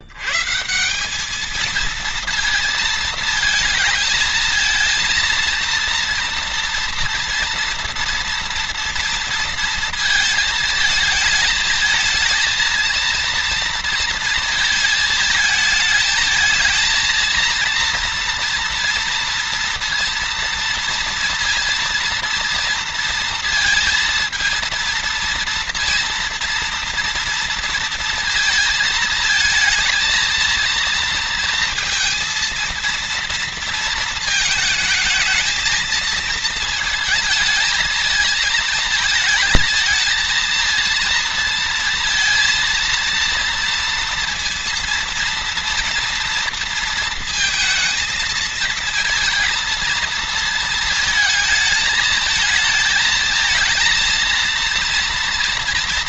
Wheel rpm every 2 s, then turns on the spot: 140, 220, 230, 240, 230, 220, 220, 230, 220, 230, 230, 230, 230, 230, 220, 230, 230, 220, 230, 220, 230, 230, 230, 230, 230, 230, 220, 230.
none